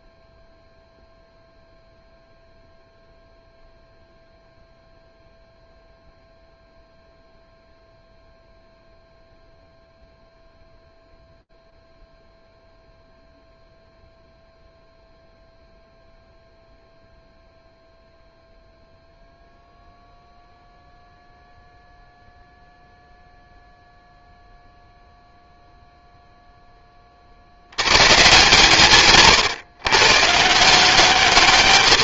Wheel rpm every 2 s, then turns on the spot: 0, 0, 0, 0, 0, 0, 0, 0, 0, 0, 0, 0, 0, 70, 130, 180.
none